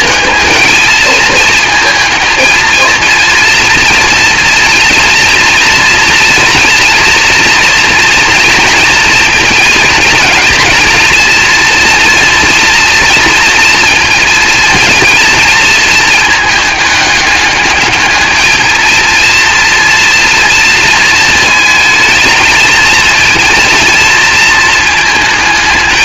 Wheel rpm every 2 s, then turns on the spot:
230, 230, 230, 230, 230, 230, 230, 230, 210, 230, 230, 230, 220.
none